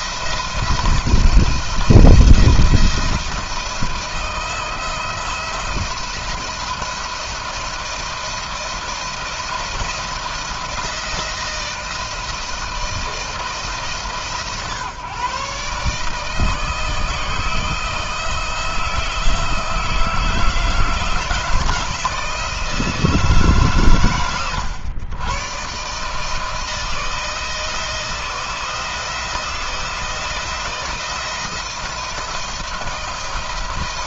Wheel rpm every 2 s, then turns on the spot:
170, 170, 170, 170, 170, 160, 170, 140, 160, 160, 160, 160, 110, 170, 160, 170, 160.
none